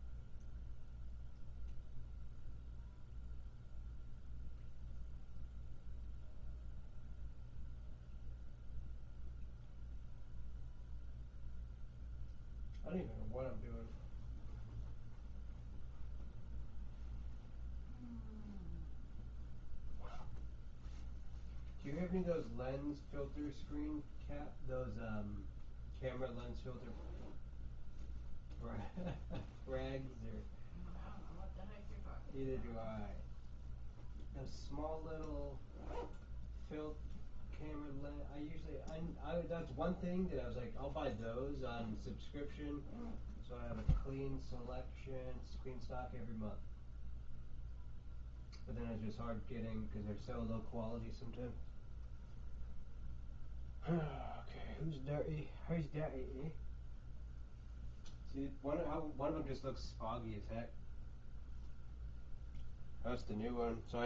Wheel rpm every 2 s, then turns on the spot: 0, 0, 0, 0, 0, 0, 0, 0, 0, 0, 0, 0, 0, 0, 0, 0, 0, 0, 0, 0, 0, 0, 0, 0, 0, 0, 0, 0, 0, 0, 0, 0.
none